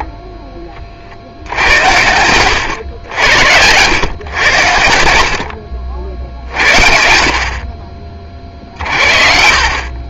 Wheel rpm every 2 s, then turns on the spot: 50, 90, 80, 50, 50.
none